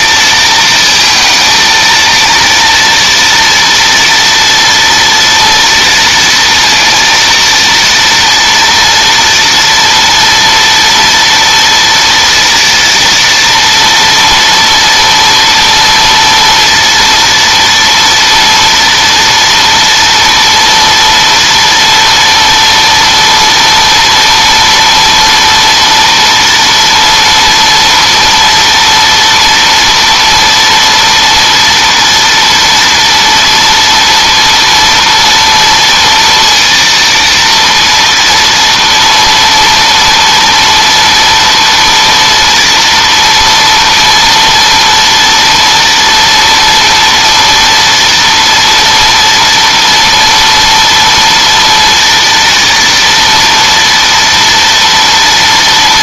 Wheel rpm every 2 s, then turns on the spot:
220, 230, 230, 230, 230, 240, 230, 230, 230, 230, 240, 230, 230, 240, 230, 230, 230, 230, 230, 230, 230, 230, 230, 230, 230, 230, 230, 230.
none